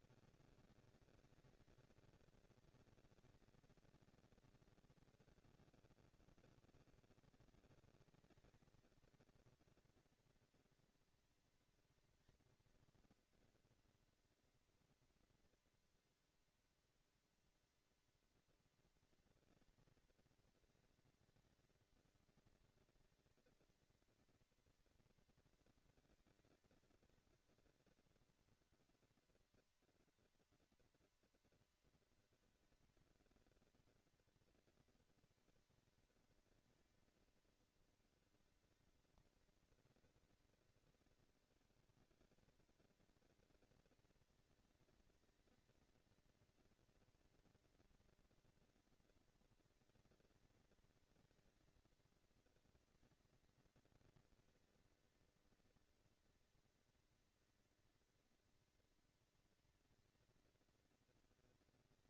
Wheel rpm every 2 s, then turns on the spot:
230, 230, 230, 230, 220, 230, 230, 230, 230, 230, 220, 230, 230, 220, 230, 230, 230, 230, 220, 210, 200, 210, 230, 230, 230, 230, 220, 230, 230, 230, 230.
none